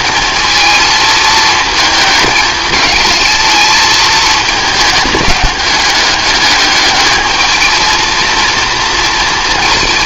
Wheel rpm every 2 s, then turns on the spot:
220, 220, 210, 210, 230.
none